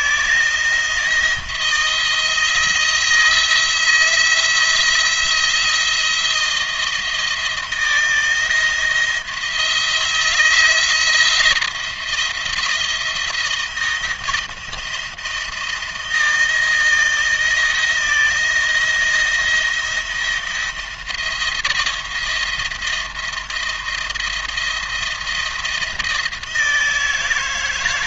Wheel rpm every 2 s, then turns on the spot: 170, 170, 170, 170, 160, 170, 170, 170, 170, 170, 170, 170, 170, 160.
none